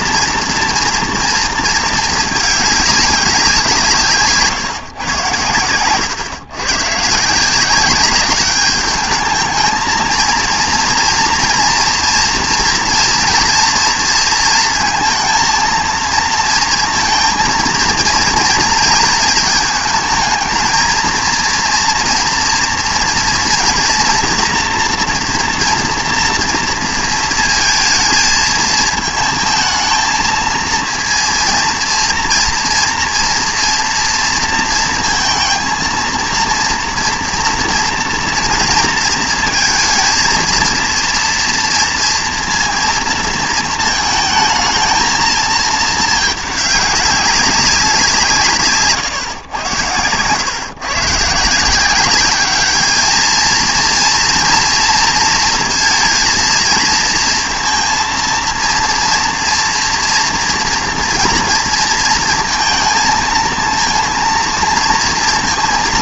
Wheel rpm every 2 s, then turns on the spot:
230, 210, 150, 130, 210, 230, 240, 230, 230, 230, 220, 230, 230, 230, 220, 230, 240, 230, 230, 230, 230, 230, 220, 210, 150, 130, 200, 230, 230, 230, 230, 230, 230.
none